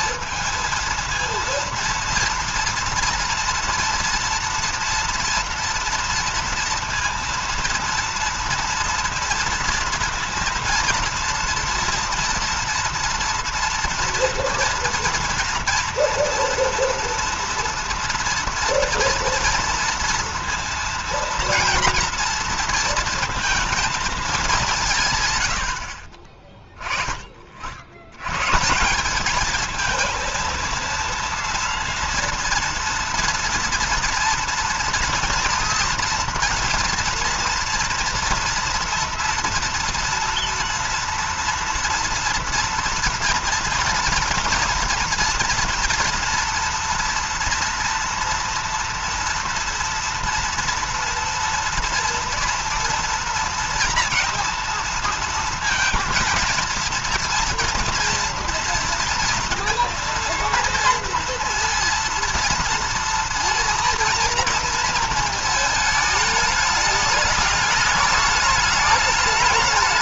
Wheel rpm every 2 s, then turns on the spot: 220, 230, 230, 230, 230, 230, 230, 230, 230, 230, 230, 240, 200, 30, 150, 230, 230, 240, 230, 230, 230, 240, 230, 230, 230, 230, 230, 230, 230, 230, 230, 230, 230, 210, 210.
none